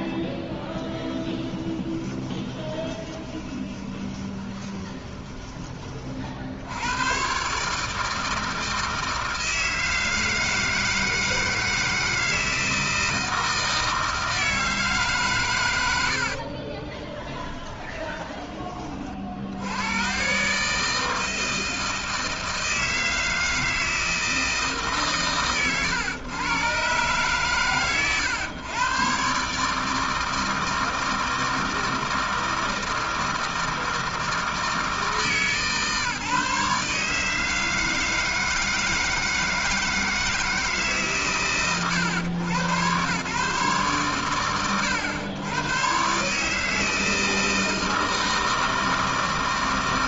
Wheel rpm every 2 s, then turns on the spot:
10, 20, 20, 90, 160, 160, 160, 160, 30, 30, 160, 160, 160, 120, 120, 160, 160, 160, 150, 160, 160, 120, 80, 150, 160.
2-6 16-18